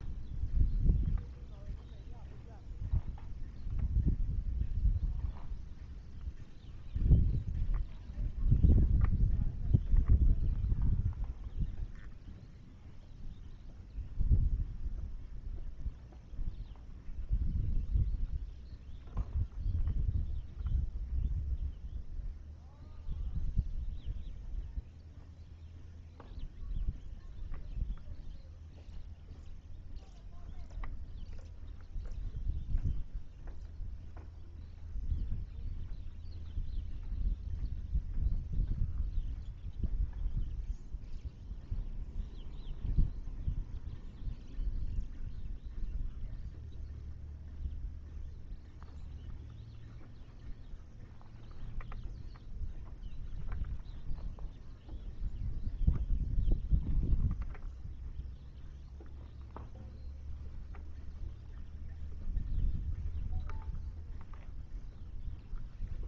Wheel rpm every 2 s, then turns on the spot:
0, 0, 0, 0, 0, 0, 0, 0, 0, 0, 0, 0, 0, 0, 0, 0, 0, 0, 0, 0, 0, 0, 0, 0, 0, 0, 0, 0, 0, 0, 0, 0, 0.
none